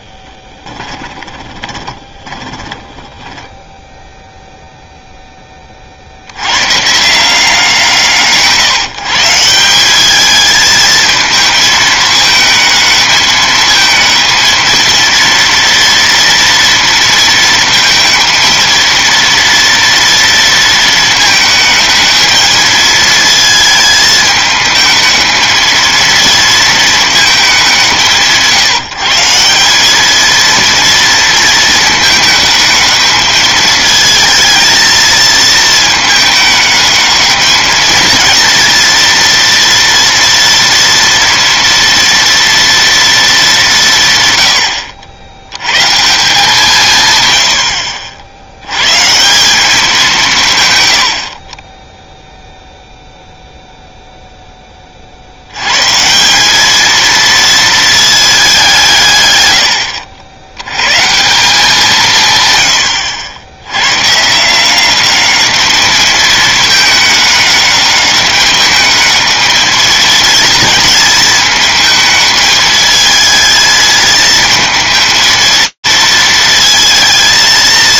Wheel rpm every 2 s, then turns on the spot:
20, 20, 0, 160, 160, 220, 220, 230, 230, 230, 220, 220, 220, 220, 170, 230, 220, 220, 220, 230, 230, 220, 80, 140, 140, 100, 0, 20, 210, 190, 90, 120, 170, 220, 210, 220, 220, 220, 220.
0-4